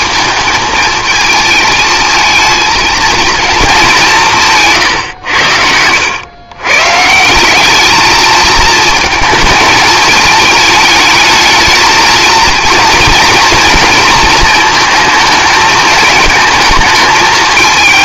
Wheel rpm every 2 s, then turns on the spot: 220, 220, 140, 140, 220, 210, 230, 220, 220.
none